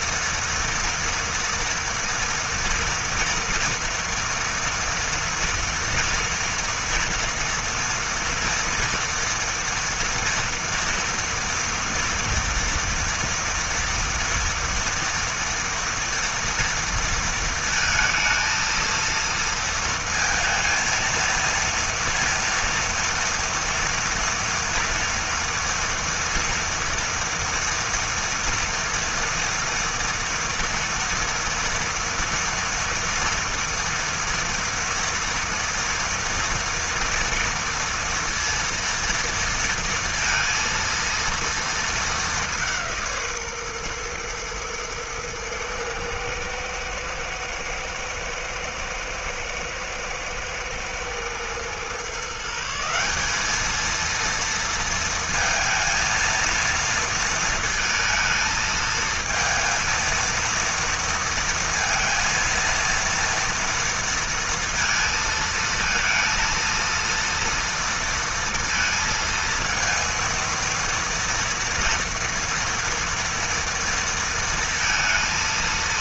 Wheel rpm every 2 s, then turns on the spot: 230, 240, 230, 240, 230, 230, 240, 230, 230, 230, 230, 230, 230, 240, 230, 230, 230, 240, 230, 230, 230, 170, 110, 110, 120, 110, 180, 230, 230, 220, 230, 230, 230, 230, 230, 230, 230, 230.
none